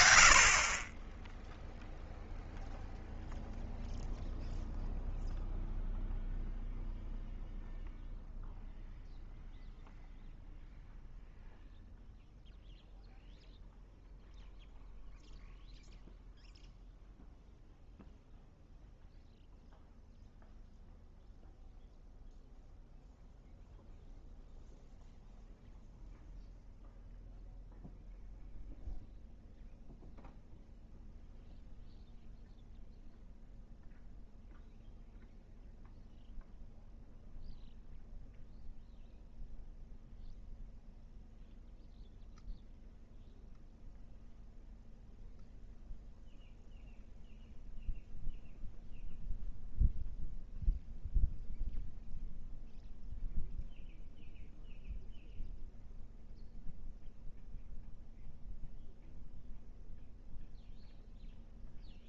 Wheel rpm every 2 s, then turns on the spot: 20, 0, 0, 0, 0, 0, 0, 0, 0, 0, 0, 0, 0, 0, 0, 0, 0, 0, 0, 0, 0, 0, 0, 0, 0, 0, 0, 0, 0, 0, 0.
none